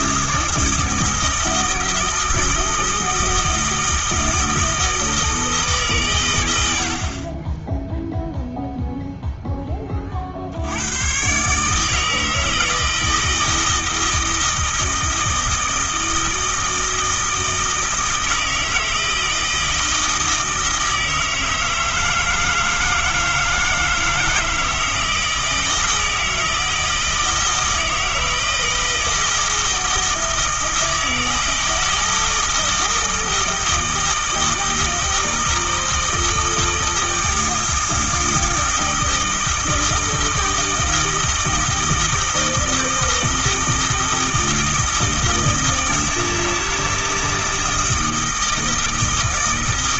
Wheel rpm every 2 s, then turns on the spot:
160, 160, 160, 70, 0, 90, 160, 160, 160, 160, 160, 160, 160, 160, 160, 160, 160, 160, 160, 160, 160, 160, 160, 160, 160.
none